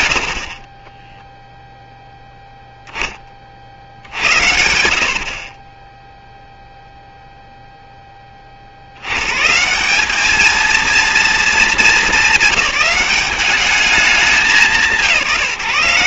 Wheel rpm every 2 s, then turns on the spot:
50, 10, 70, 0, 90, 230, 190, 190.
none